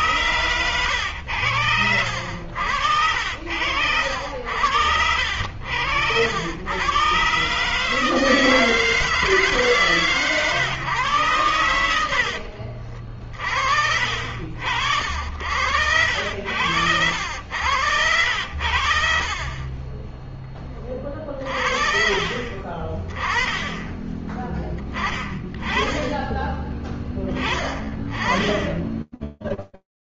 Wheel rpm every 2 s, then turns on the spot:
100, 70, 70, 110, 160, 130, 50, 70, 70, 70, 30, 30, 10, 20, 10.
none